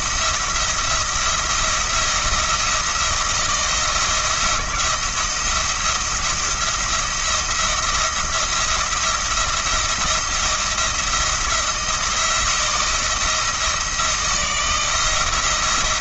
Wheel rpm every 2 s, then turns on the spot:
170, 170, 170, 170, 170, 170, 160, 170.
none